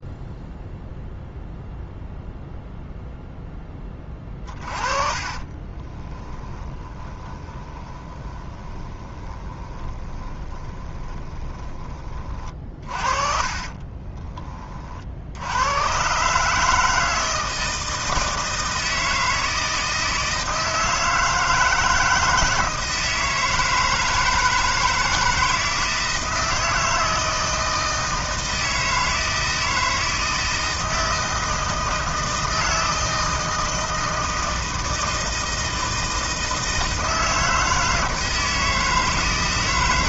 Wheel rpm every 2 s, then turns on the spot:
0, 0, 30, 20, 20, 20, 50, 30, 160, 160, 160, 160, 160, 160, 160, 160, 160, 160, 160, 160.
4-14